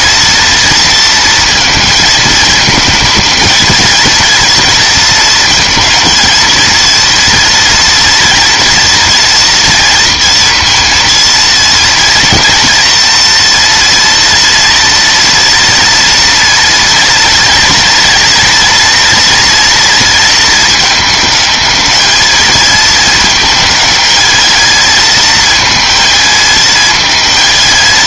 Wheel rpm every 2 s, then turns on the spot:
230, 220, 230, 230, 230, 230, 230, 230, 230, 230, 220, 220, 220, 220.
none